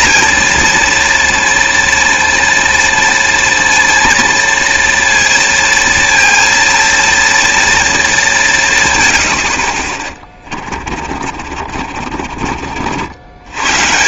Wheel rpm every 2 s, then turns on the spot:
240, 230, 230, 230, 140, 30, 50.
10-12